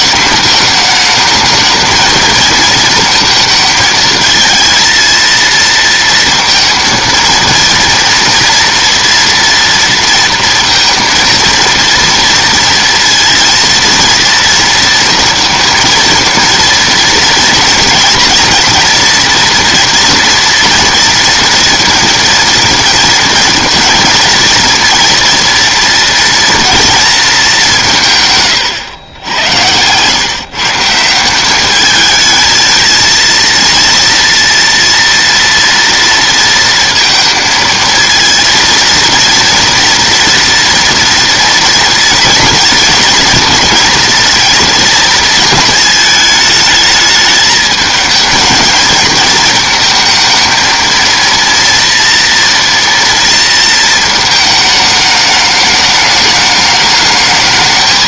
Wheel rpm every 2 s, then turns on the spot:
220, 230, 220, 230, 240, 230, 230, 230, 230, 230, 230, 230, 230, 230, 130, 140, 220, 230, 230, 230, 230, 230, 230, 210, 220, 230, 230, 210, 210.
28-30